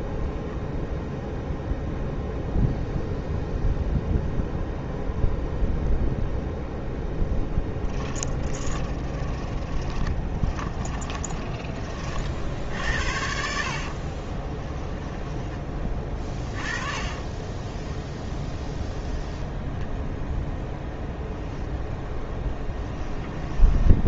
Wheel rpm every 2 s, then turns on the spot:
0, 0, 0, 0, 10, 20, 60, 10, 30, 0, 10, 10.
8-12 14-18 22-24